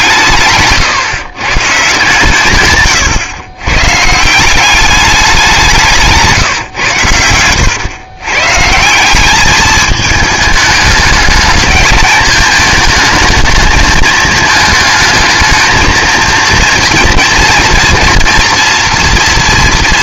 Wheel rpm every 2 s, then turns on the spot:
140, 140, 200, 140, 140, 210, 230, 220, 230, 230.
none